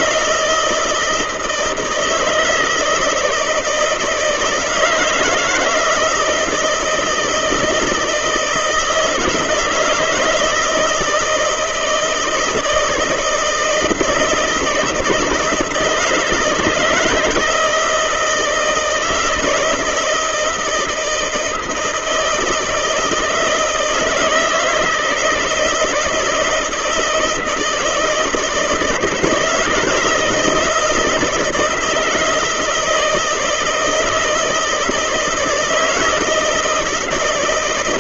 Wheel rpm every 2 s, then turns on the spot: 160, 160, 160, 160, 160, 160, 160, 160, 160, 160, 160, 160, 160, 160, 160, 160, 160, 170, 160.
none